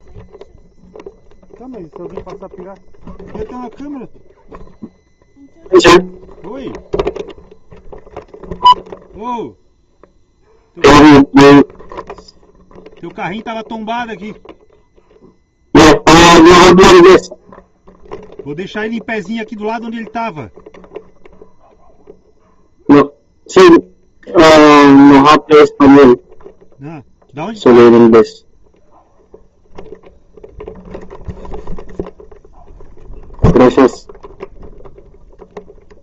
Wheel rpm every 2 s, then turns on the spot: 0, 0, 0, 0, 0, 0, 0, 0, 0, 0, 0, 0, 0, 0, 0, 0, 0, 0.
none